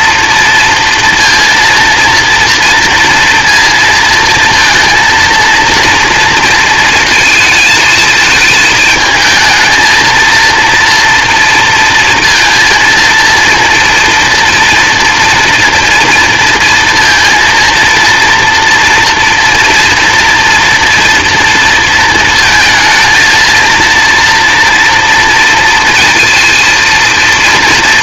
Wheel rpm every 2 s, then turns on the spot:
230, 230, 230, 230, 220, 230, 230, 230, 230, 240, 240, 230, 230, 230.
none